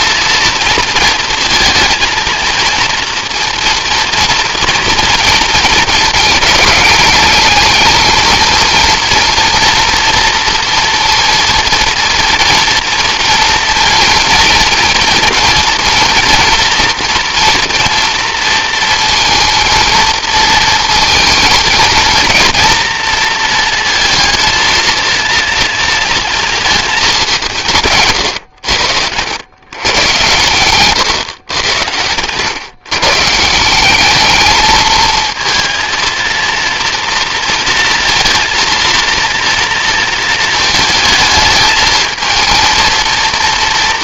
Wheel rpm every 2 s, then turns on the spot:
230, 230, 230, 220, 230, 230, 230, 230, 240, 230, 230, 230, 230, 230, 110, 120, 100, 210, 230, 230, 220, 220.
32-34